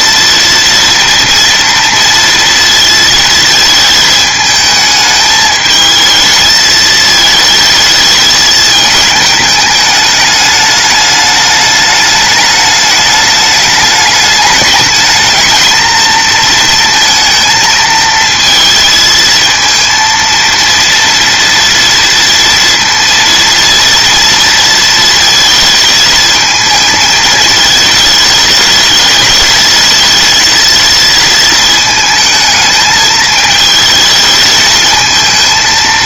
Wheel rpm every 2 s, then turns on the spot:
240, 230, 220, 220, 210, 210, 210, 210, 230, 230, 230, 230, 230, 220, 210, 230, 220, 220.
none